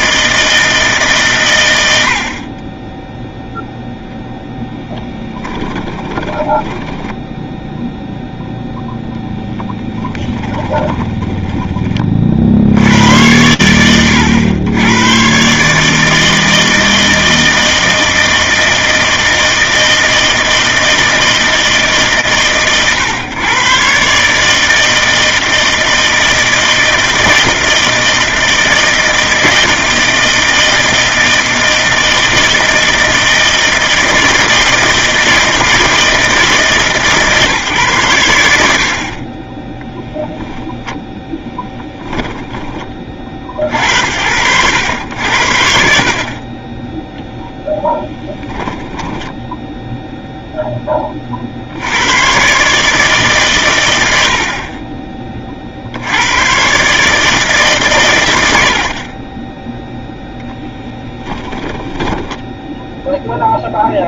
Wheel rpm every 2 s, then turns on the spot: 160, 20, 20, 10, 0, 10, 40, 80, 160, 160, 160, 110, 160, 160, 160, 160, 160, 160, 150, 70, 10, 20, 90, 10, 10, 10, 150, 40, 120, 80, 10, 10.
4-8 10-12 48-50 60-62